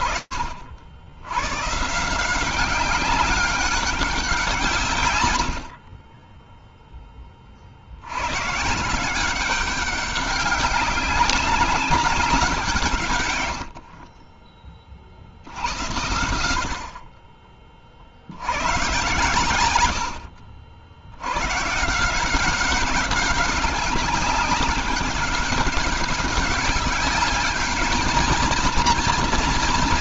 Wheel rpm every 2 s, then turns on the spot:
70, 190, 130, 20, 180, 200, 110, 70, 40, 120, 100, 190, 190, 210, 240.
none